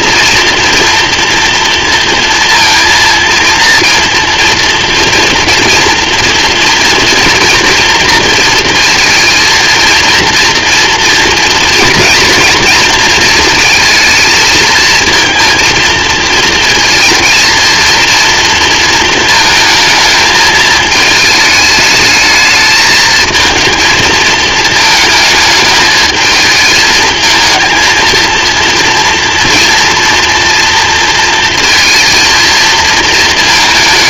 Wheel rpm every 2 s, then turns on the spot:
230, 230, 230, 230, 230, 230, 230, 220, 230, 230, 220, 220, 220, 220, 230, 230, 220.
none